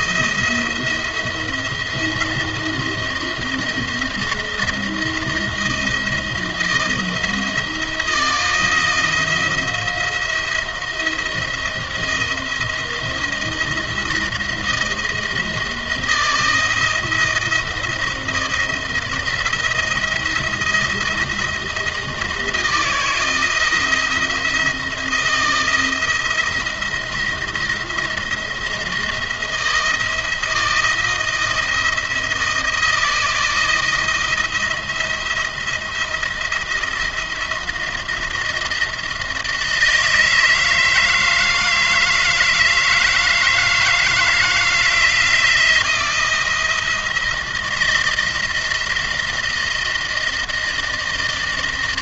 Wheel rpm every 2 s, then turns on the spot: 170, 170, 170, 170, 160, 170, 170, 170, 170, 170, 170, 160, 160, 170, 170, 170, 160, 170, 170, 170, 160, 160, 160, 170, 160, 160.
none